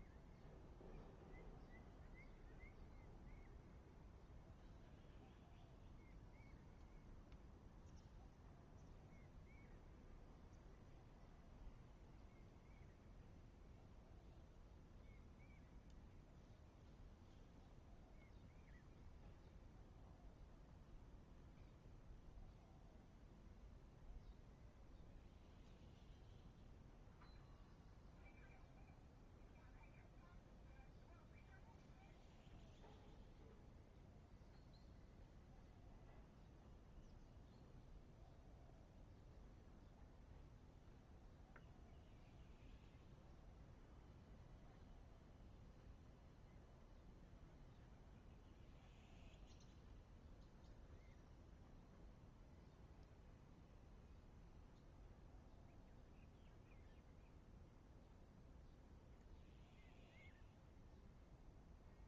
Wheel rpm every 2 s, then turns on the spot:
0, 0, 0, 0, 0, 0, 0, 0, 0, 0, 0, 0, 0, 0, 0, 0, 0, 0, 0, 0, 0, 0, 0, 0, 0, 0, 0, 0, 0, 0, 0.
none